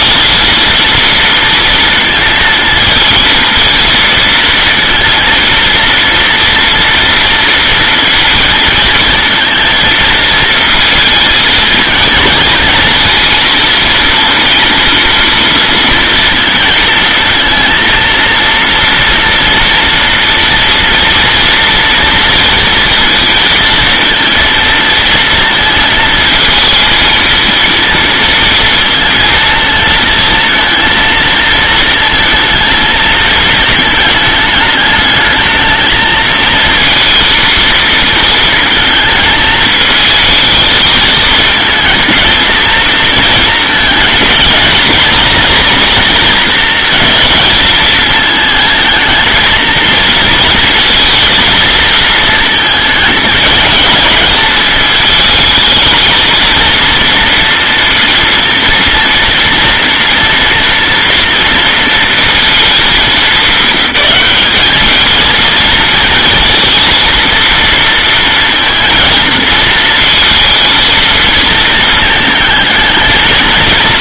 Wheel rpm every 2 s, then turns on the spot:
230, 230, 230, 230, 230, 230, 230, 220, 230, 230, 230, 230, 230, 220, 230, 230, 220, 210, 230, 230, 220, 220, 220, 220, 220, 230, 220, 220, 230, 230, 230, 230, 210, 230, 230, 230, 220.
none